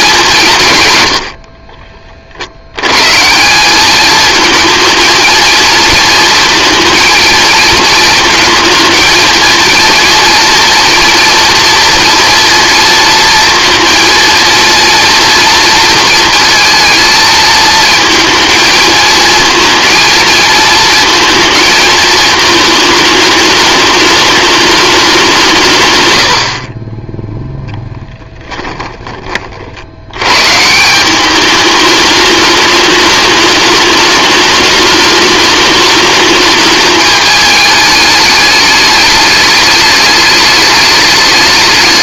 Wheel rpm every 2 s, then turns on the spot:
140, 110, 220, 230, 230, 230, 230, 240, 230, 220, 220, 220, 200, 40, 10, 140, 210, 210, 210, 210, 210.
none